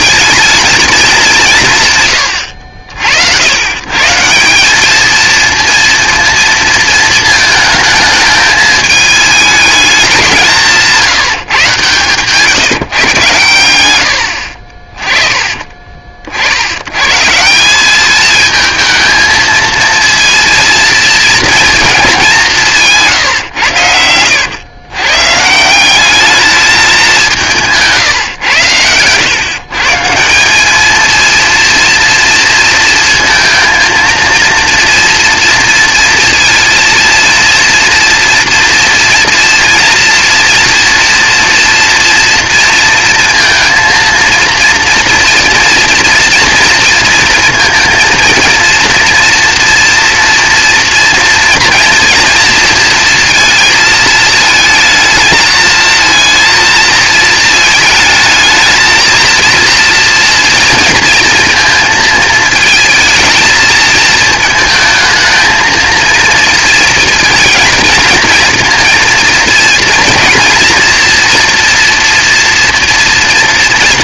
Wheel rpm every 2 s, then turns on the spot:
220, 70, 210, 230, 210, 170, 130, 30, 100, 220, 230, 170, 120, 210, 110, 210, 230, 230, 230, 240, 240, 230, 230, 230, 230, 230, 230, 220, 230, 220, 230, 220, 220, 230, 230, 240, 240.
none